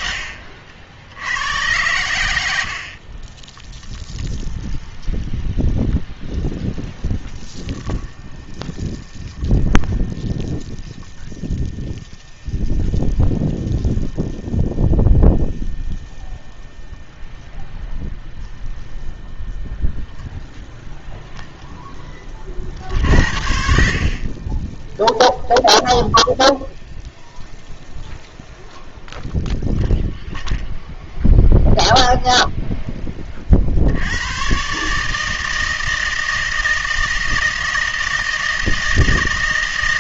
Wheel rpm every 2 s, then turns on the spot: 70, 60, 0, 0, 0, 0, 0, 0, 0, 0, 0, 60, 10, 0, 0, 0, 0, 130, 160, 160.
none